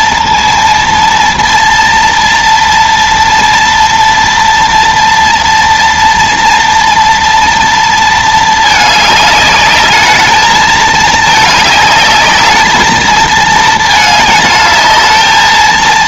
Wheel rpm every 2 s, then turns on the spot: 230, 230, 230, 230, 220, 210, 220, 220.
none